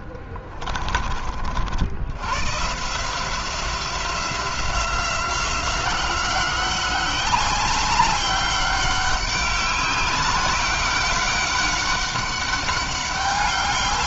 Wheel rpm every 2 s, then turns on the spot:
30, 140, 180, 180, 200, 200, 200.
none